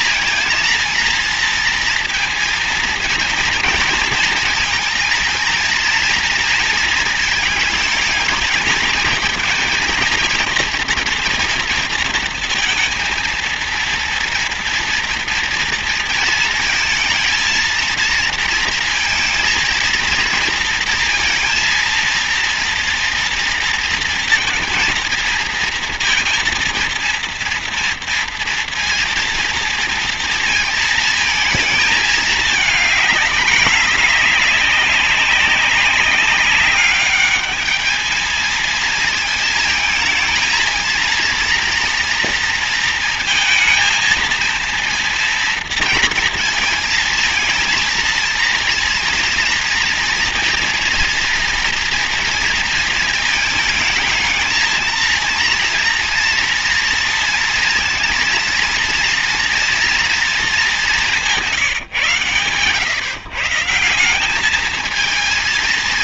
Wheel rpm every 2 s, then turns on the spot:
230, 230, 230, 230, 220, 230, 230, 230, 220, 230, 230, 230, 230, 230, 230, 230, 220, 210, 200, 220, 220, 230, 230, 220, 230, 230, 230, 220, 230, 230, 220, 130, 200.
none